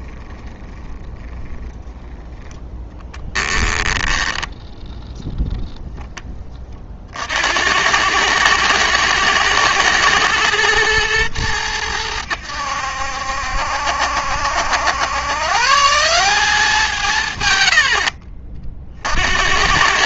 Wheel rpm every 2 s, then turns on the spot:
10, 20, 10, 40, 110, 110, 80, 90, 170, 50.
2-4